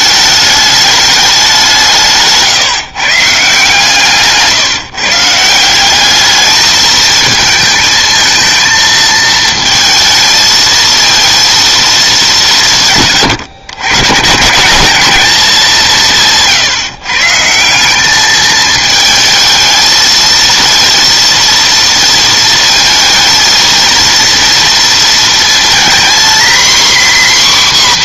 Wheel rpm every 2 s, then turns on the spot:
210, 150, 150, 220, 220, 230, 160, 190, 160, 220, 230, 230, 230, 250.
none